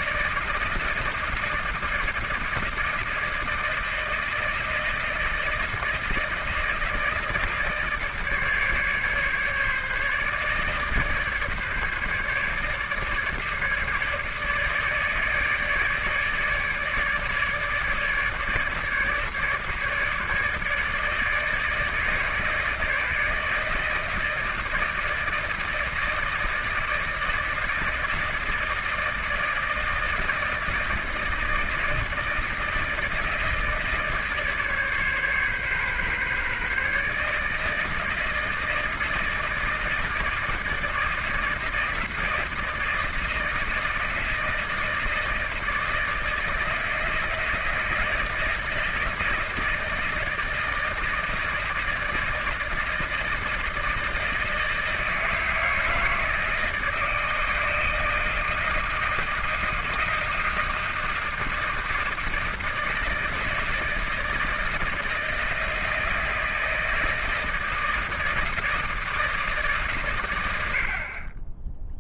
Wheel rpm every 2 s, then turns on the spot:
160, 160, 160, 160, 150, 150, 150, 150, 150, 150, 150, 150, 160, 160, 160, 160, 160, 150, 140, 160, 170, 160, 160, 160, 170, 160, 160, 160, 160, 160, 160, 160, 160, 160, 170, 90.
none